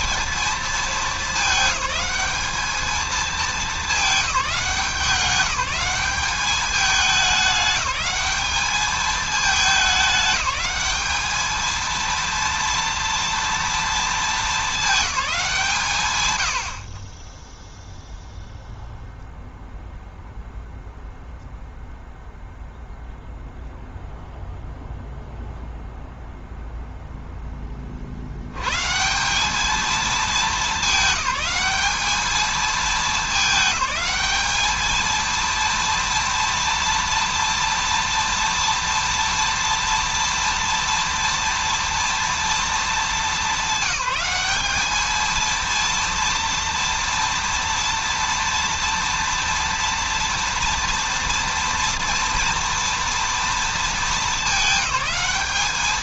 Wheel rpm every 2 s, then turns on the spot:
220, 220, 190, 210, 210, 210, 230, 220, 70, 0, 0, 0, 0, 0, 110, 220, 210, 220, 230, 230, 240, 220, 210, 230, 240, 240, 230, 210.
none